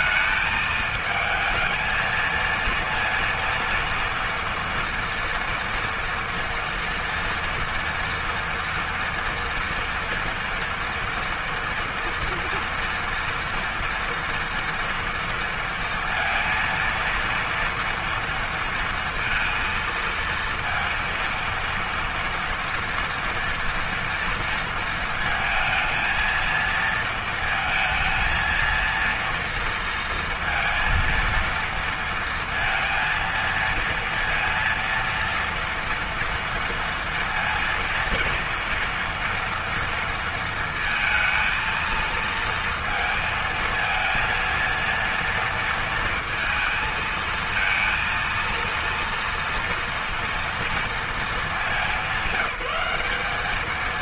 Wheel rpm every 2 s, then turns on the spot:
220, 230, 230, 230, 230, 240, 230, 230, 230, 230, 230, 230, 220, 220, 230, 230, 230, 230, 230, 230, 230, 230, 230, 230, 230, 220, 190.
none